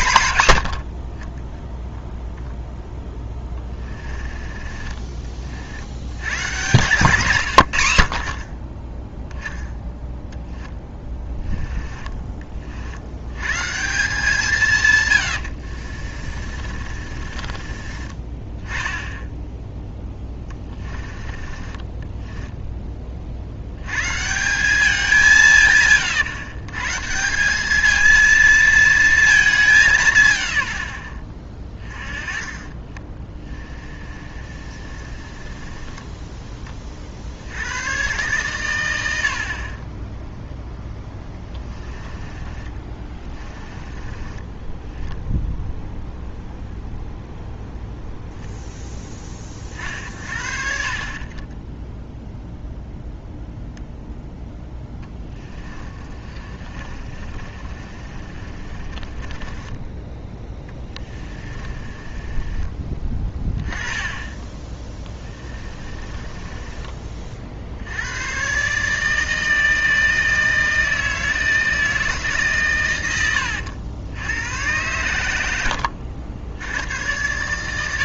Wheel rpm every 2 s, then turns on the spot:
70, 0, 20, 140, 20, 10, 40, 140, 40, 20, 20, 10, 190, 140, 230, 90, 20, 30, 30, 110, 0, 20, 20, 0, 0, 50, 0, 10, 30, 30, 20, 20, 20, 20, 130, 160, 130, 100, 90.
4-6 10-12 16-18 20-22 32-36 42-46 56-62 66-68